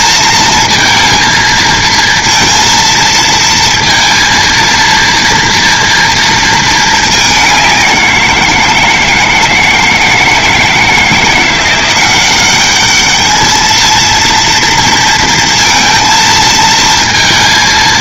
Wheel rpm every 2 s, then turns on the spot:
230, 230, 230, 220, 170, 160, 200, 230, 230.
none